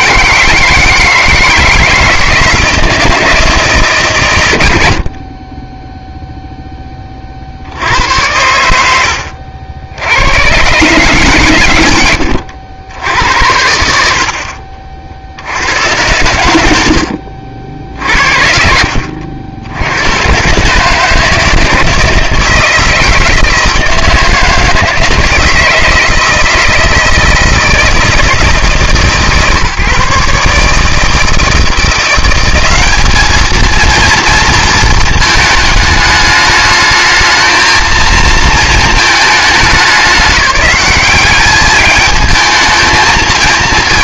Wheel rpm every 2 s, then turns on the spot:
160, 160, 90, 10, 90, 130, 90, 50, 80, 60, 140, 160, 160, 160, 160, 150, 190, 230, 210, 220, 200, 220.
none